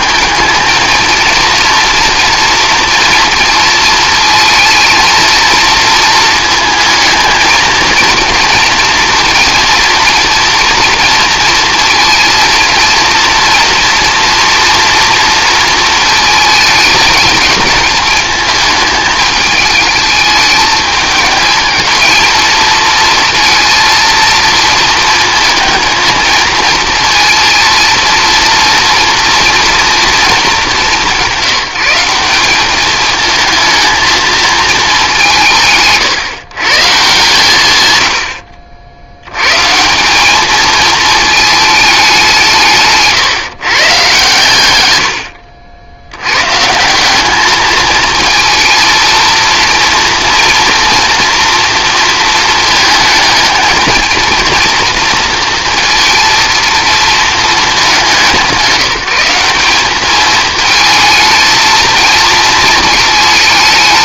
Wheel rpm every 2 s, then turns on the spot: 220, 230, 230, 220, 230, 240, 230, 240, 220, 220, 210, 230, 230, 220, 230, 200, 200, 220, 150, 70, 220, 150, 100, 150, 230, 230, 220, 230, 230, 180, 220, 220.
none